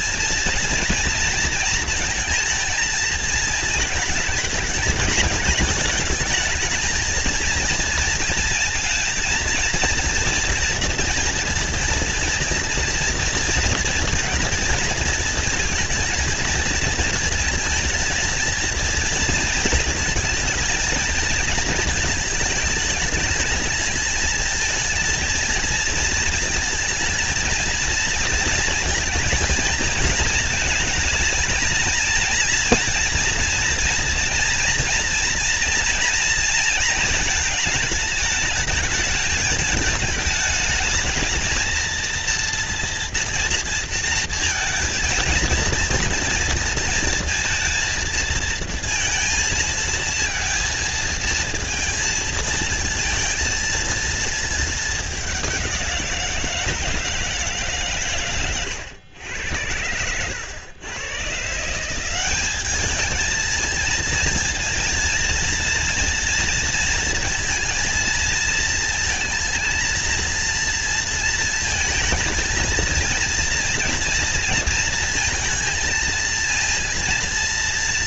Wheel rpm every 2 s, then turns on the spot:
230, 230, 220, 220, 230, 230, 230, 230, 230, 230, 230, 210, 220, 230, 230, 220, 230, 230, 230, 220, 210, 240, 220, 230, 230, 230, 230, 220, 170, 110, 110, 200, 230, 230, 230, 230, 230, 230, 230.
none